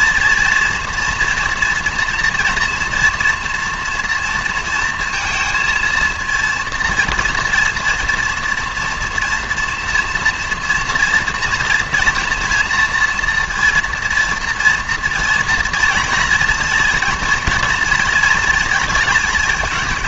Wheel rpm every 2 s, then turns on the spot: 230, 230, 230, 230, 240, 230, 240, 230, 230, 230.
none